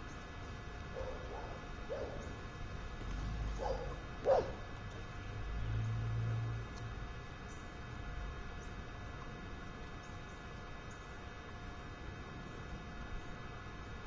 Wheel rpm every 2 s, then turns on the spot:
0, 0, 0, 0, 0, 0, 0.
none